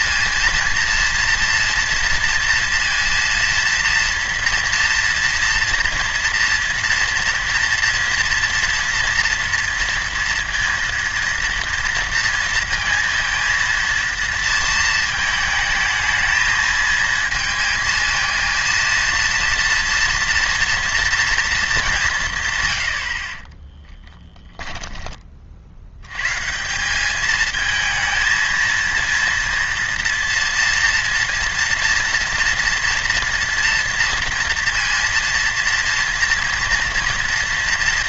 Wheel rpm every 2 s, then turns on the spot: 230, 230, 240, 230, 230, 230, 230, 220, 220, 230, 230, 90, 10, 160, 230, 240, 230, 230, 230.
none